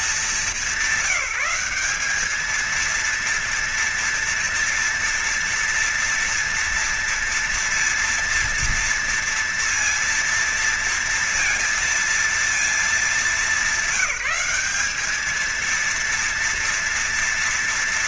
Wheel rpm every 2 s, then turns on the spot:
210, 200, 230, 230, 230, 230, 230, 210, 230.
none